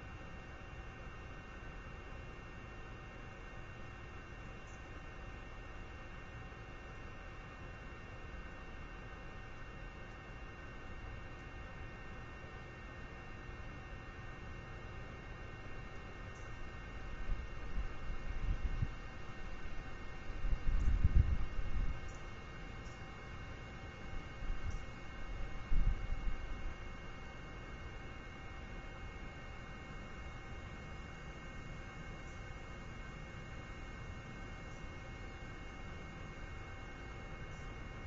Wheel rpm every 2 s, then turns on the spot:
0, 0, 0, 0, 0, 0, 0, 0, 0, 0, 0, 0, 0, 0, 0, 0, 0, 0, 0.
none